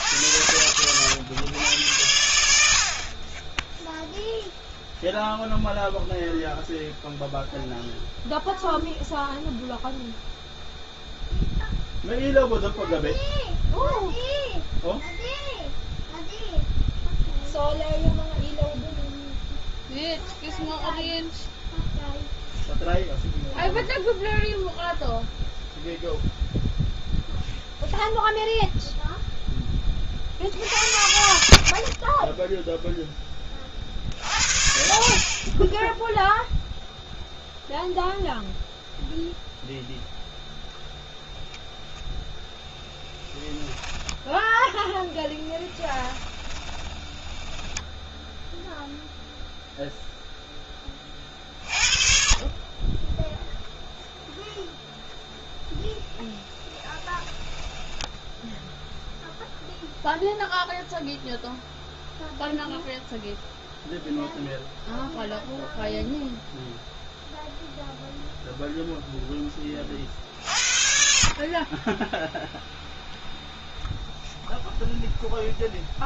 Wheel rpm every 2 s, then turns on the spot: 100, 80, 0, 0, 0, 0, 0, 0, 0, 0, 0, 0, 0, 0, 0, 50, 10, 60, 0, 0, 0, 0, 10, 20, 0, 0, 40, 0, 20, 0, 0, 0, 0, 0, 0, 50, 0, 0.
44-48 56-58